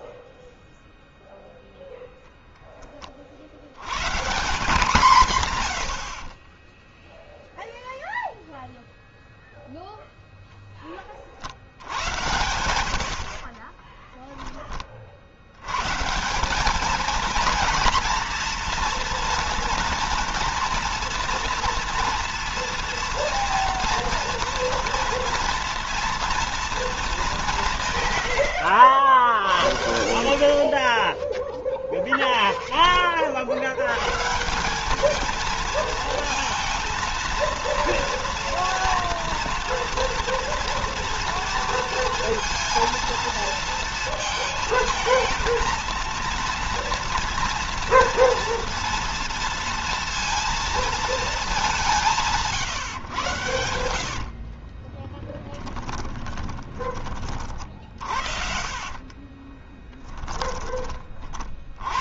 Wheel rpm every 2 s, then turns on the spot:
0, 20, 170, 10, 0, 20, 80, 40, 210, 230, 230, 230, 230, 220, 80, 30, 10, 190, 230, 230, 230, 230, 230, 230, 230, 230, 140, 20, 30, 40, 20.
6-8 30-32 54-56 58-60